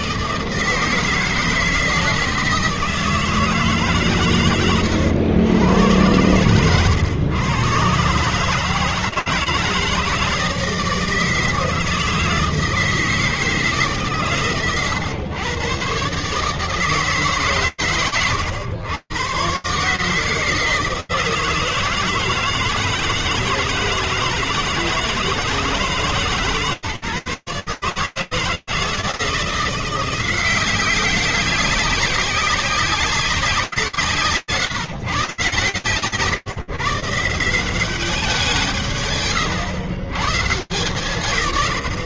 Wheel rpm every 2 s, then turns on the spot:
150, 160, 140, 110, 120, 160, 160, 150, 130, 110, 160, 160, 160, 160, 150, 170, 190, 150, 130, 170, 130.
none